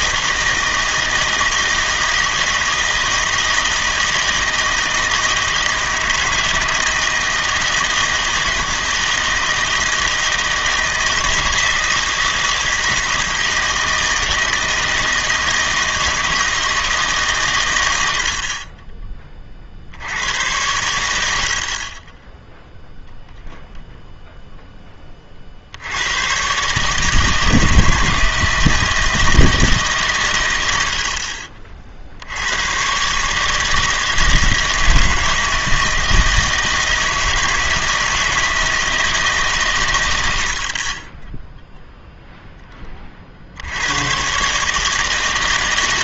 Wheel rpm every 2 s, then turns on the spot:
160, 160, 160, 160, 160, 160, 160, 160, 160, 30, 100, 0, 10, 130, 160, 90, 110, 160, 160, 160, 40, 10, 150.
18-20